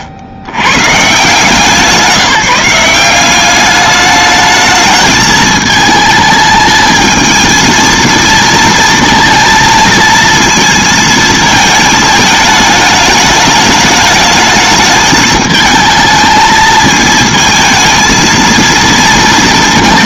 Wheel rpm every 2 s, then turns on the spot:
90, 180, 220, 220, 230, 230, 210, 210, 220, 230.
none